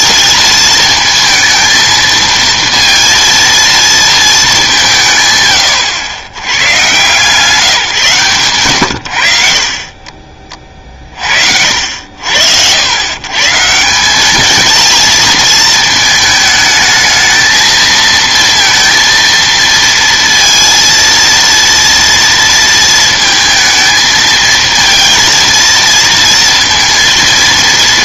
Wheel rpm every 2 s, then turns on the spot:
220, 230, 200, 140, 120, 30, 90, 220, 220, 230, 230, 230, 230, 230.
none